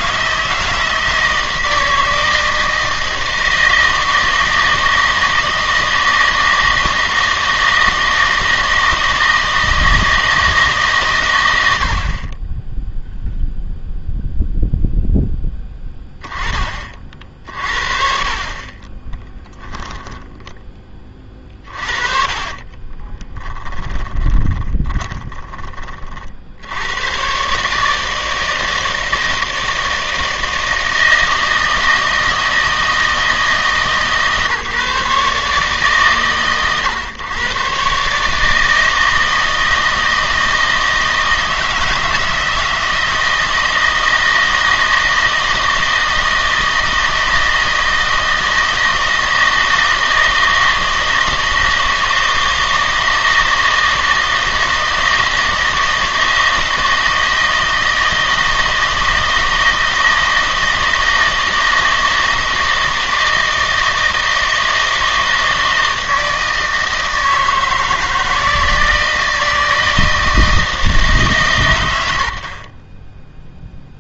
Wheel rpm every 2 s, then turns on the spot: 160, 160, 160, 160, 160, 160, 10, 0, 30, 30, 10, 20, 20, 80, 160, 160, 160, 150, 130, 160, 160, 160, 160, 160, 160, 160, 160, 160, 160, 160, 160, 160, 160, 160, 160, 160, 40.
18-20 22-26